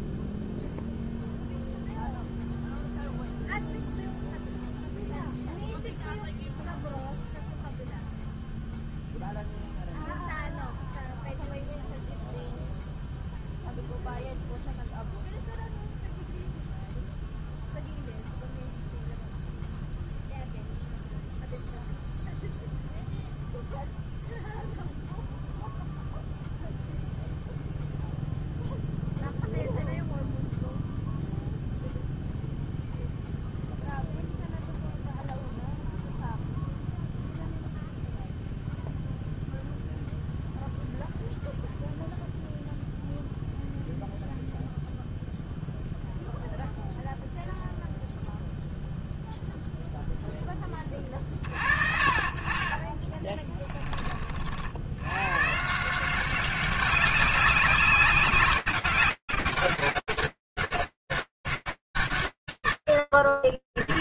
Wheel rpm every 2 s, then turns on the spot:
0, 0, 0, 0, 0, 0, 0, 0, 0, 0, 0, 0, 0, 0, 0, 0, 0, 0, 0, 0, 0, 0, 0, 0, 0, 10, 40, 50, 190, 200, 200, 150.
none